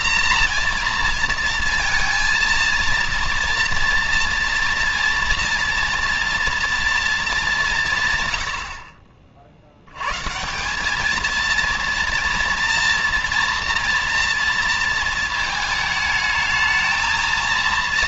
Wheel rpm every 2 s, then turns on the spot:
230, 230, 230, 230, 110, 140, 230, 230, 220.
none